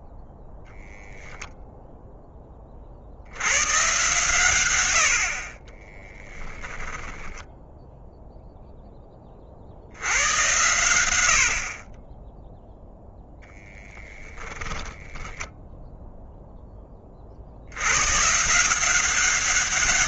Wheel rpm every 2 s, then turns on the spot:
0, 40, 80, 10, 10, 100, 0, 20, 20, 170.
6-8 14-16